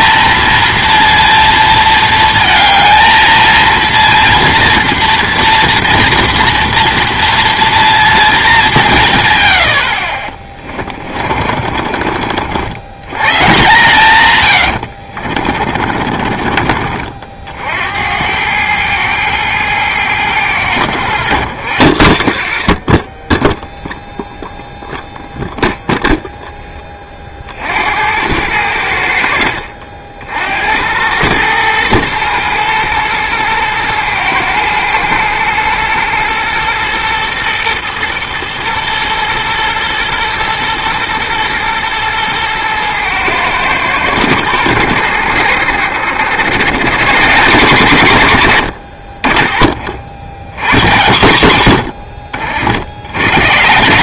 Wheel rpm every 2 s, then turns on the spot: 230, 220, 230, 230, 190, 30, 70, 100, 40, 100, 100, 50, 0, 10, 90, 70, 120, 110, 120, 110, 110, 110, 90, 110, 80, 100, 60.
10-12 14-18